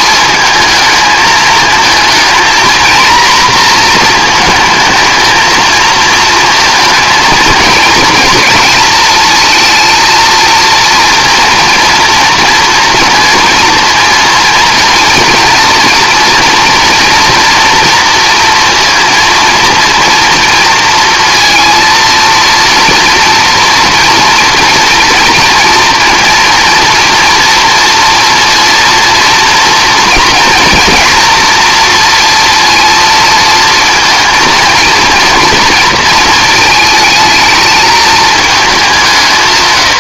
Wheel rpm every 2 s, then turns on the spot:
220, 240, 220, 230, 220, 230, 230, 230, 230, 230, 230, 230, 230, 230, 230, 230, 230, 230, 220, 180.
none